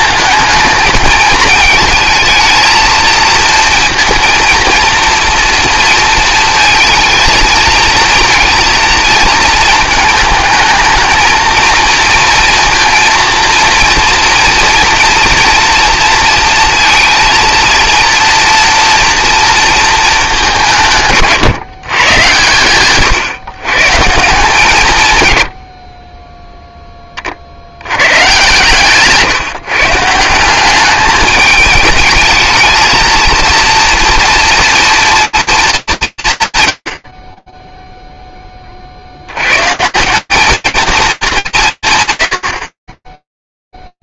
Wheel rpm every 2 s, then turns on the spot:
220, 230, 230, 230, 230, 220, 230, 230, 230, 230, 180, 120, 160, 10, 130, 200, 220, 230, 160, 10, 190, 70.
none